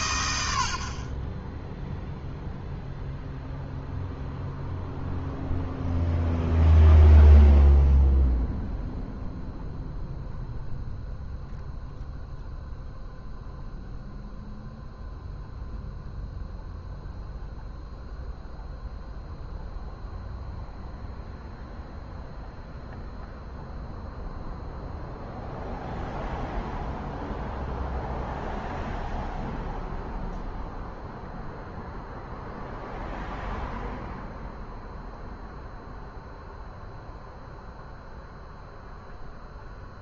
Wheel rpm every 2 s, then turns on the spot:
90, 0, 0, 0, 0, 0, 0, 0, 0, 0, 0, 0, 0, 0, 0, 0, 0, 0, 0, 0.
none